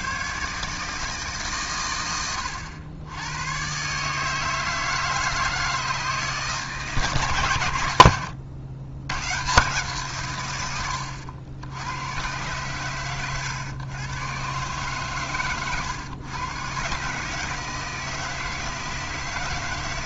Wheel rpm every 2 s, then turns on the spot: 100, 160, 140, 130, 90, 110, 140, 150, 160, 160.
none